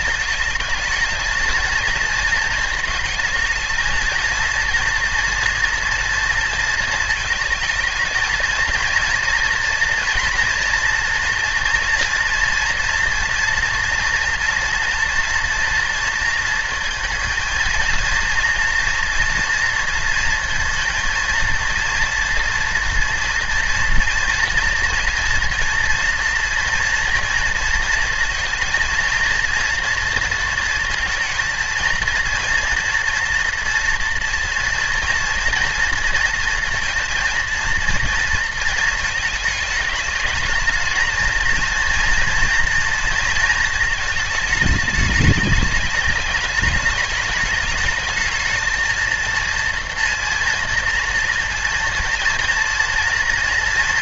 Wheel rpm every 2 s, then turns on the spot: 220, 220, 230, 220, 230, 230, 230, 230, 230, 230, 230, 240, 240, 230, 230, 230, 230, 230, 230, 220, 210, 230, 220, 210, 220, 230, 230.
none